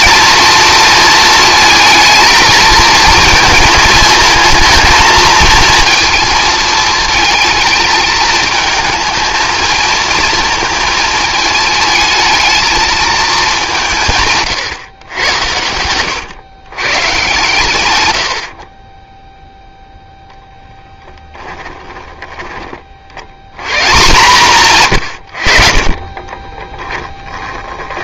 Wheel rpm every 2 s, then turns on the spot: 230, 220, 230, 220, 220, 220, 220, 120, 120, 30, 10, 30, 150, 20.
20-22 26-28